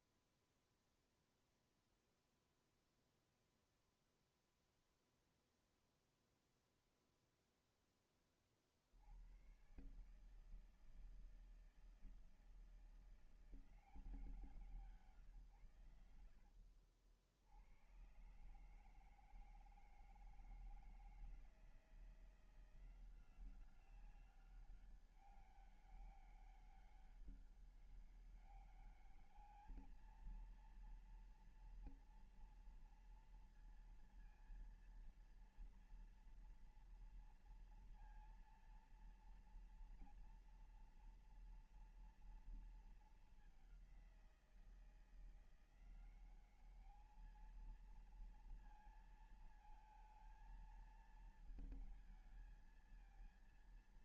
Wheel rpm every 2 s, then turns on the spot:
0, 0, 0, 0, 40, 150, 160, 170, 80, 140, 160, 170, 190, 200, 200, 230, 230, 230, 230, 230, 230, 230, 180, 190, 230, 230, 230.
none